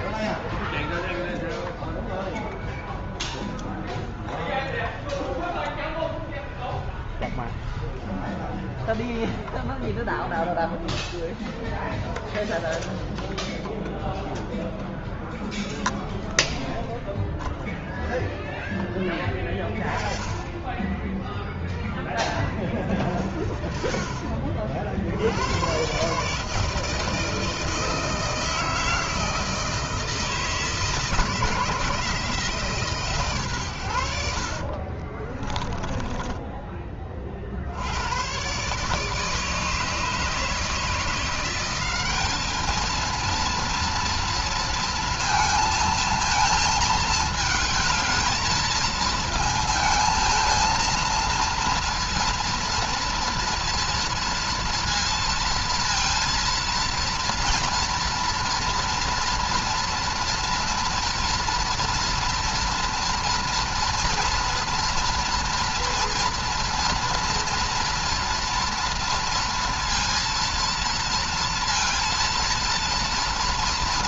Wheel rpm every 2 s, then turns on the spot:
0, 0, 0, 0, 0, 0, 0, 0, 0, 0, 10, 10, 40, 150, 160, 160, 150, 60, 20, 120, 160, 210, 230, 220, 220, 230, 230, 230, 230, 230, 230, 230, 230, 240, 230, 230, 230.
34-36